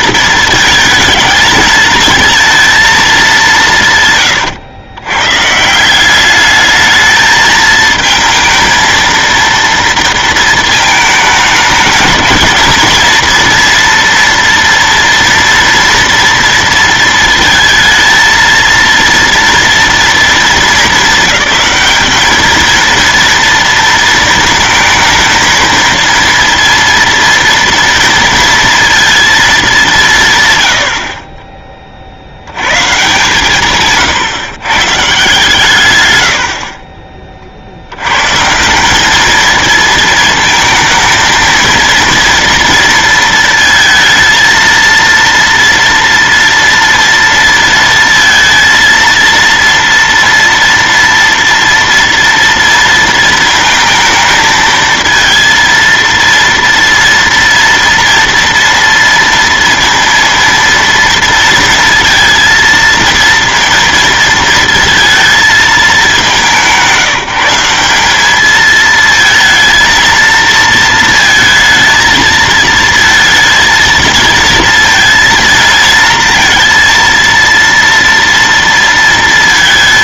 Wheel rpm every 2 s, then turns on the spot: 220, 230, 110, 210, 220, 230, 230, 230, 230, 230, 220, 230, 220, 230, 230, 90, 120, 130, 50, 170, 230, 230, 230, 230, 230, 230, 230, 220, 230, 230, 230, 230, 220, 180, 220, 230, 220, 230, 230, 230.
36-38